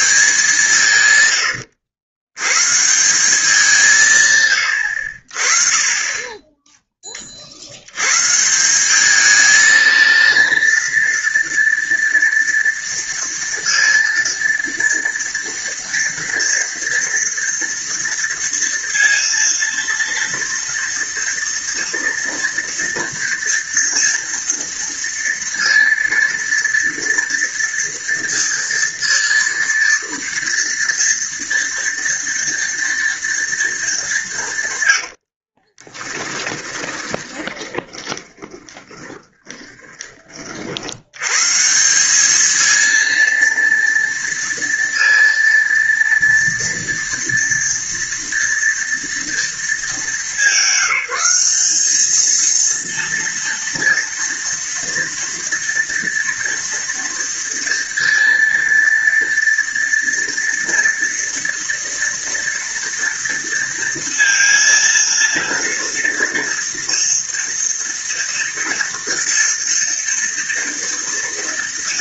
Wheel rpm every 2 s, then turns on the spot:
160, 150, 80, 20, 190, 230, 230, 230, 230, 230, 230, 230, 230, 230, 230, 230, 230, 110, 20, 20, 80, 220, 230, 230, 230, 210, 230, 230, 230, 230, 240, 230, 230, 230, 230, 230.
34-40